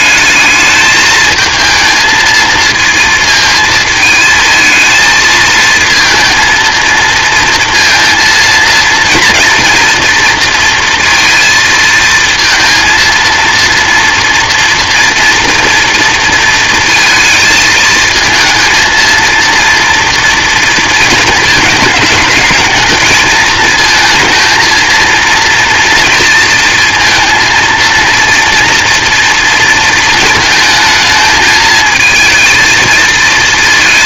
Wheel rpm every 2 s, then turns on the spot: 210, 220, 220, 230, 230, 230, 230, 230, 230, 230, 230, 220, 230, 230, 230, 220, 230.
none